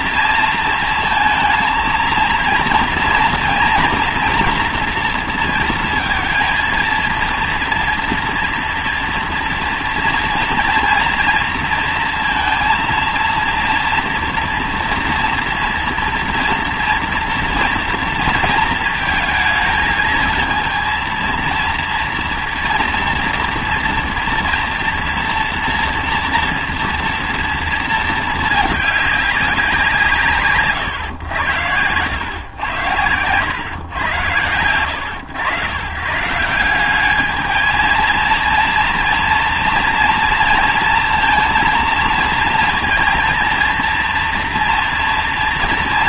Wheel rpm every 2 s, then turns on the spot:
230, 230, 230, 230, 230, 230, 230, 230, 230, 220, 230, 230, 230, 230, 220, 110, 110, 80, 190, 230, 230, 230, 230.
none